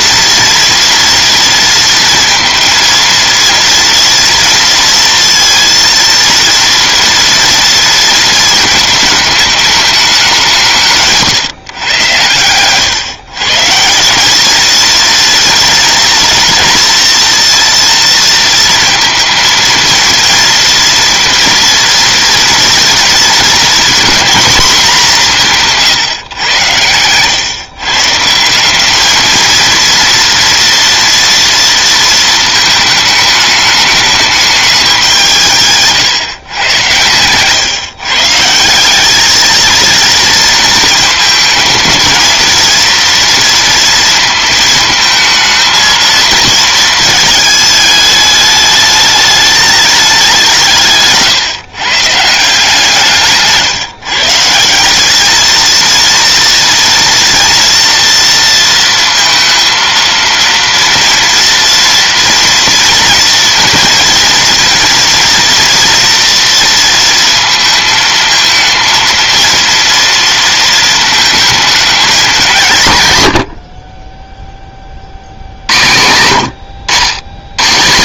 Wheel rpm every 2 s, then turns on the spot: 230, 230, 230, 230, 220, 180, 120, 210, 230, 230, 230, 230, 230, 110, 180, 230, 220, 200, 120, 170, 230, 230, 220, 230, 210, 170, 160, 170, 230, 230, 230, 230, 230, 230, 220, 230, 170, 20, 90.
none